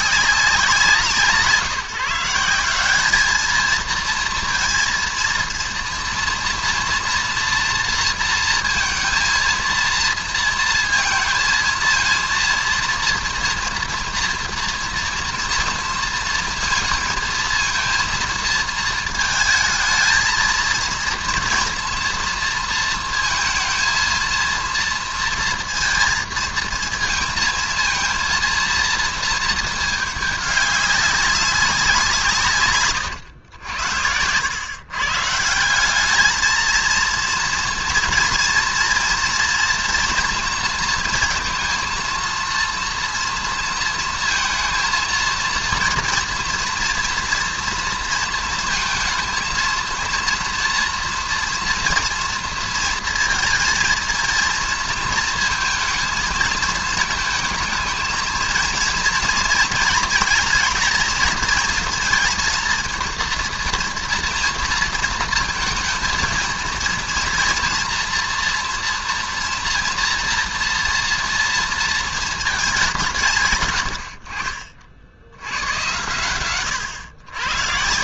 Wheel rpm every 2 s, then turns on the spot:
190, 180, 230, 230, 230, 230, 230, 230, 230, 230, 230, 230, 230, 230, 230, 200, 150, 100, 220, 240, 230, 230, 230, 230, 230, 230, 230, 230, 230, 220, 230, 230, 230, 230, 230, 230, 220, 60, 110.
none